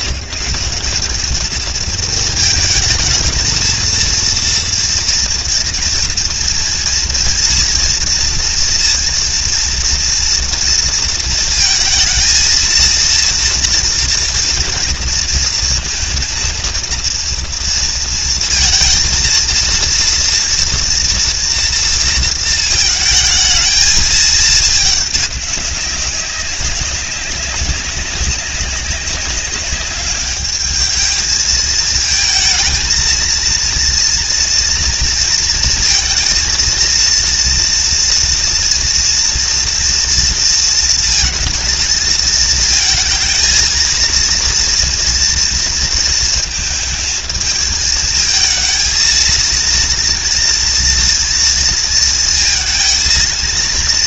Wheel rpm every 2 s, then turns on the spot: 200, 220, 230, 230, 230, 230, 230, 230, 230, 230, 230, 230, 210, 200, 190, 220, 230, 230, 230, 230, 230, 220, 230, 220, 220, 230, 230.
none